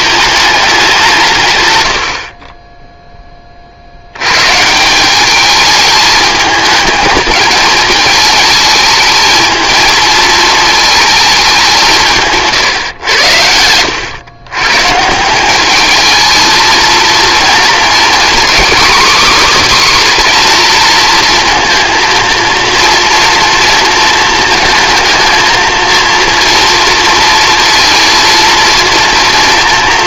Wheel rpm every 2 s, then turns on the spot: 200, 20, 150, 220, 220, 220, 140, 140, 220, 270, 230, 230, 230, 230, 230.
none